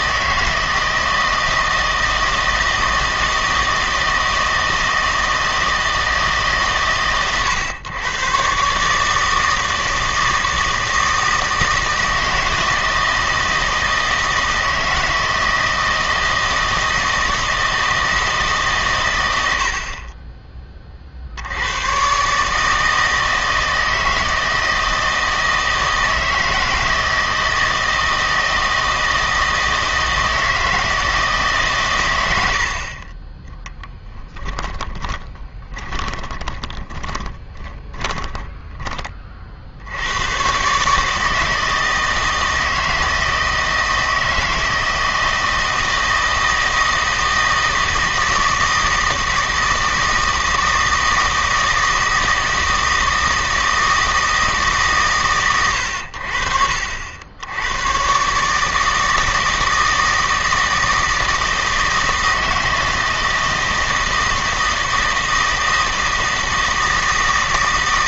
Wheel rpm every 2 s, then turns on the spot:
160, 160, 160, 140, 140, 160, 160, 160, 160, 150, 30, 150, 160, 160, 160, 160, 60, 20, 20, 20, 130, 160, 160, 160, 160, 160, 160, 150, 60, 150, 160, 160, 160, 160.
34-38